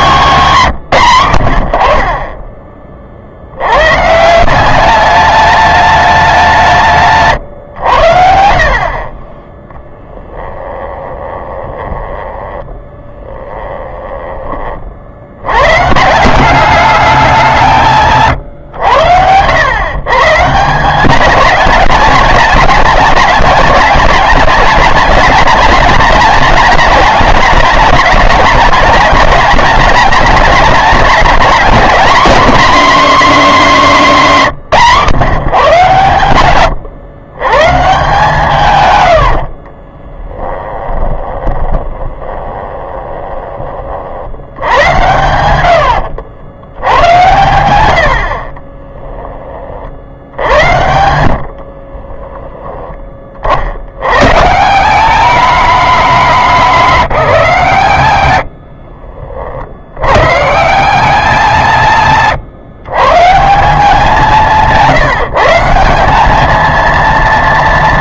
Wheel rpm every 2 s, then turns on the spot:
190, 20, 190, 180, 60, 30, 10, 30, 200, 120, 160, 200, 210, 220, 220, 210, 260, 150, 110, 130, 10, 20, 90, 90, 30, 80, 20, 170, 200, 70, 170, 150, 170, 220.
10-14 40-44 48-50 58-60